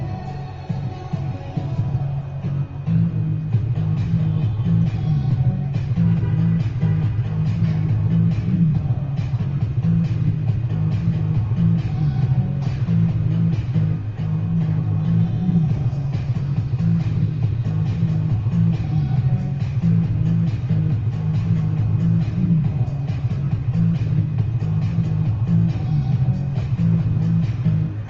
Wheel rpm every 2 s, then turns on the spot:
0, 0, 0, 0, 0, 0, 0, 0, 0, 0, 0, 0, 0, 0.
none